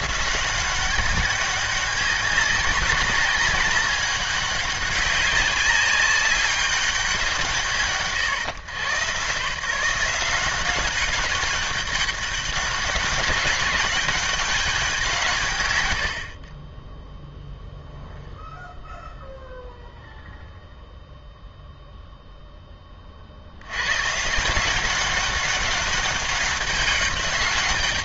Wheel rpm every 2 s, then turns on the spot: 190, 200, 200, 200, 130, 190, 190, 190, 30, 0, 0, 10, 170, 200.
none